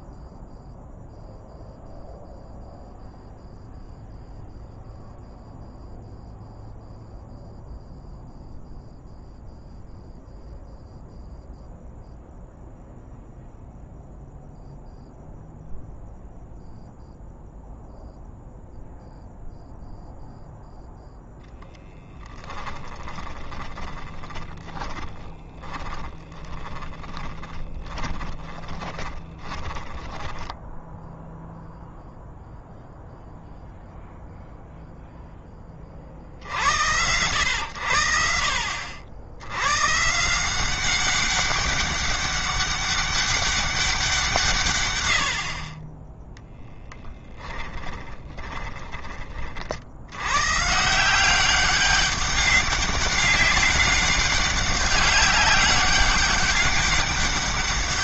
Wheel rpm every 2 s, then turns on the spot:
0, 0, 0, 0, 0, 0, 0, 0, 0, 0, 0, 10, 30, 10, 20, 10, 0, 0, 90, 60, 180, 200, 110, 10, 20, 160, 200, 190, 200.
22-32 46-48